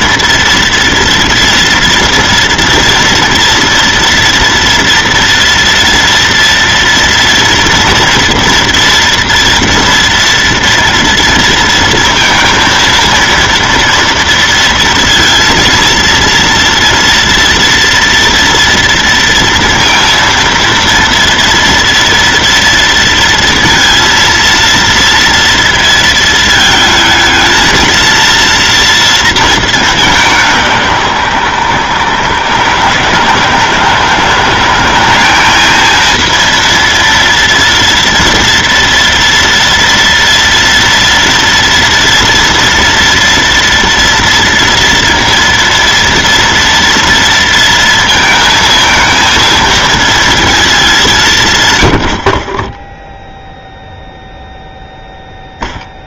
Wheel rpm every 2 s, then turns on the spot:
230, 230, 230, 230, 240, 230, 230, 240, 230, 230, 230, 230, 230, 220, 230, 180, 140, 180, 230, 230, 230, 230, 230, 230, 230, 220, 20, 0.
none